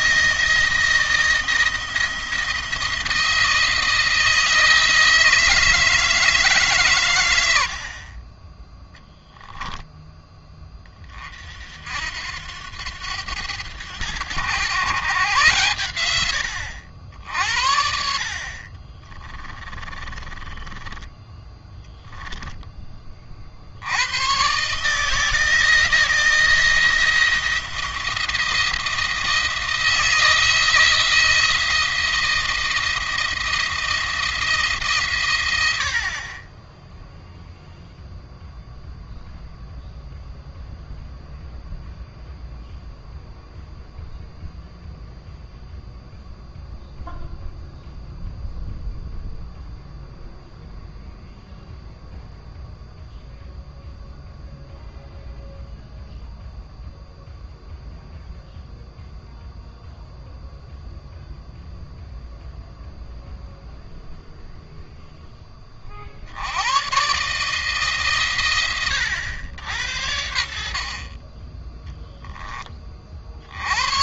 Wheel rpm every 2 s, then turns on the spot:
170, 160, 160, 140, 10, 20, 90, 130, 80, 30, 20, 20, 140, 160, 170, 170, 170, 150, 10, 0, 0, 0, 0, 0, 0, 0, 0, 0, 0, 0, 0, 0, 0, 110, 110, 50, 30.
18-22